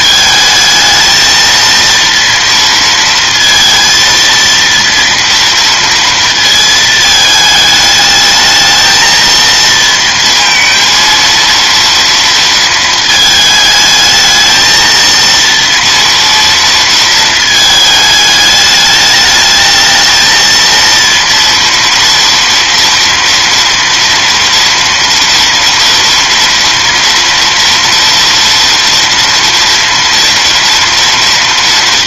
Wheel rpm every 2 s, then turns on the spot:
220, 230, 230, 220, 220, 230, 230, 220, 230, 210, 230, 230, 230, 230, 230, 230.
none